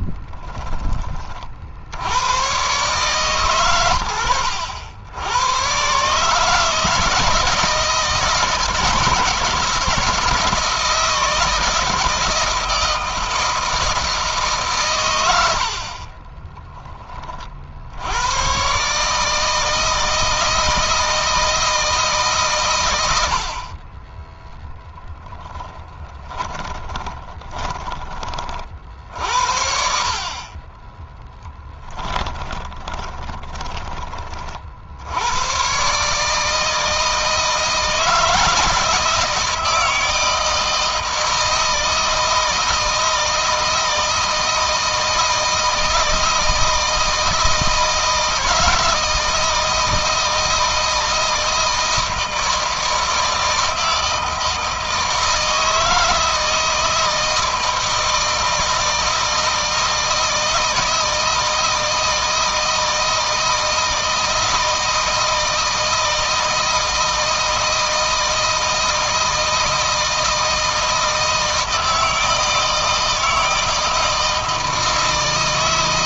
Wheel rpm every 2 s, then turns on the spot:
20, 120, 90, 160, 170, 160, 160, 120, 20, 140, 160, 110, 0, 20, 50, 20, 30, 70, 160, 160, 160, 160, 160, 160, 160, 160, 160, 160, 160, 160, 160, 160, 160, 160, 160, 160, 160, 160.
26-28 32-34